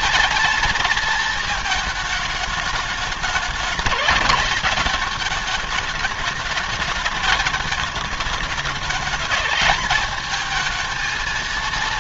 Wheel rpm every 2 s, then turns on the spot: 230, 210, 220, 210, 220, 220.
none